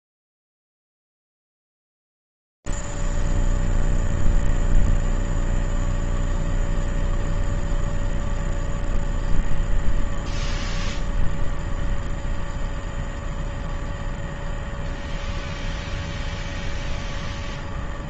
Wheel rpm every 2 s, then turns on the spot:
0, 0, 0, 0, 0, 0, 0, 0, 0.
none